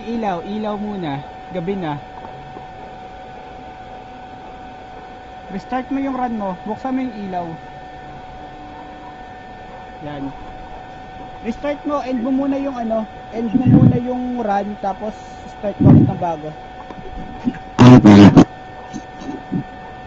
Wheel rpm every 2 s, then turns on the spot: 0, 0, 0, 0, 0, 0, 0, 0, 0, 0.
none